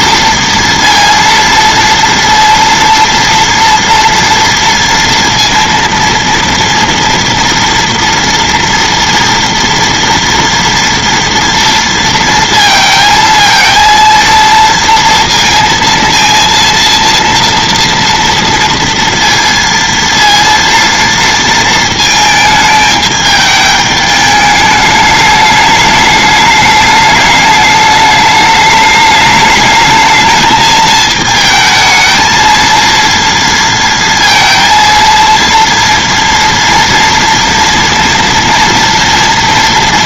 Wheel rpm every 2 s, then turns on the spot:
230, 230, 230, 230, 230, 230, 230, 230, 230, 230, 230, 220, 210, 210, 210, 220, 230, 230, 230, 230.
none